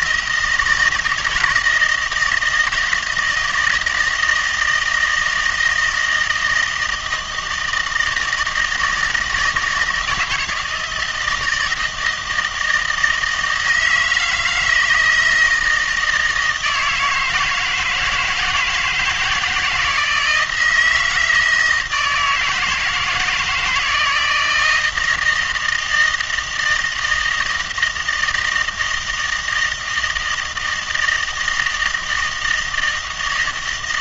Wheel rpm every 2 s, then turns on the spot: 160, 160, 160, 160, 160, 160, 160, 160, 160, 160, 170, 160, 160, 160, 160, 160, 160.
none